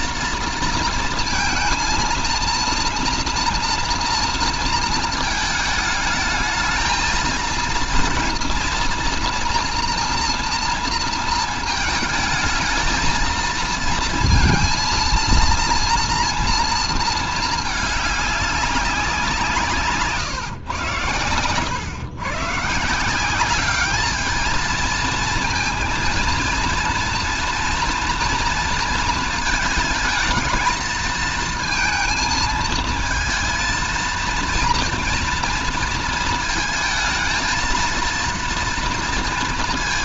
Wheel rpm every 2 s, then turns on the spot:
230, 230, 230, 220, 230, 230, 220, 230, 230, 190, 120, 150, 220, 230, 230, 220, 220, 230, 220, 230.
none